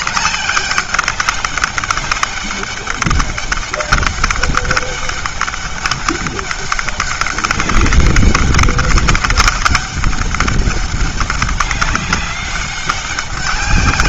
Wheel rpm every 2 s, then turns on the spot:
200, 200, 200, 200, 200, 200, 200.
none